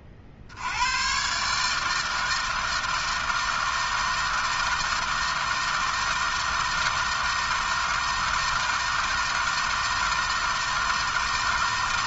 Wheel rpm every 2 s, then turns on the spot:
80, 160, 160, 160, 160, 160.
none